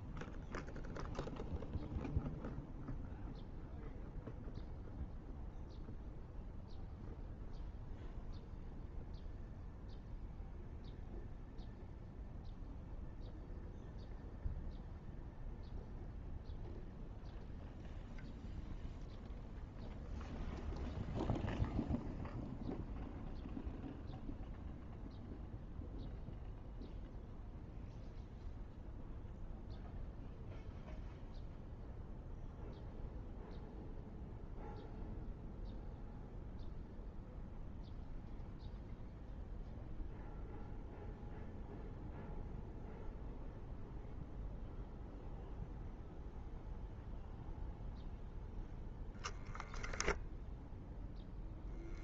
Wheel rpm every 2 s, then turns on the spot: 0, 0, 0, 0, 0, 0, 0, 0, 0, 0, 0, 0, 0, 0, 0, 0, 0, 0, 0, 0, 0, 0, 0, 0, 0, 0.
none